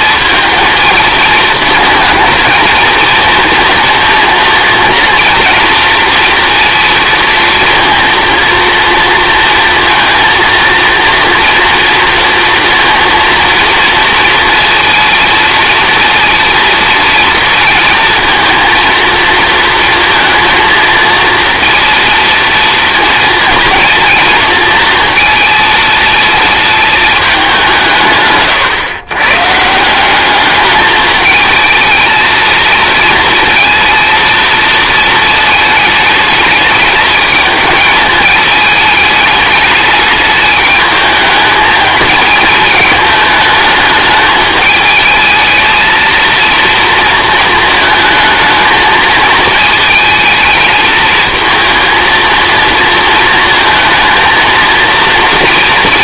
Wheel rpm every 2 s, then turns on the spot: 230, 230, 230, 230, 230, 230, 230, 230, 230, 230, 230, 230, 230, 220, 130, 210, 230, 220, 210, 220, 210, 220, 220, 230, 220, 220, 230, 220.
none